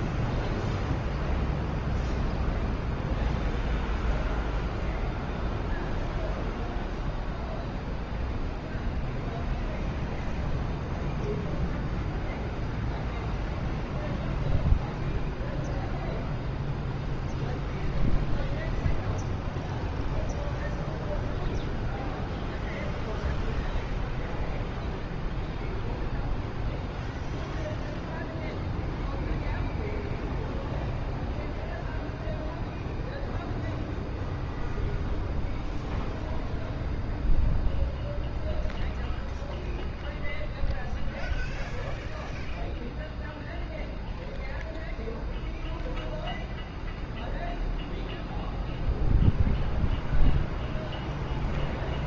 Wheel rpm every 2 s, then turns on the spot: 0, 0, 0, 0, 0, 0, 0, 0, 0, 0, 0, 0, 0, 0, 0, 0, 0, 0, 0, 0, 0, 0, 0, 0, 0, 0.
none